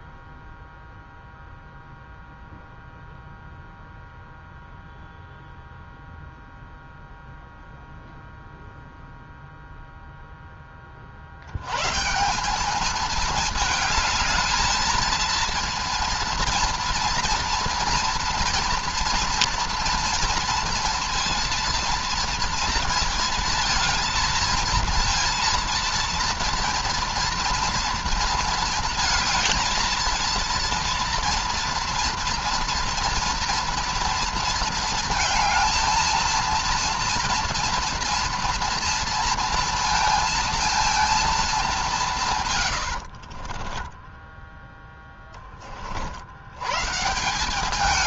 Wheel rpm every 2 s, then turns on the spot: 0, 0, 0, 0, 0, 20, 200, 220, 230, 230, 230, 230, 230, 240, 230, 230, 230, 230, 230, 230, 230, 130, 10, 110.
42-46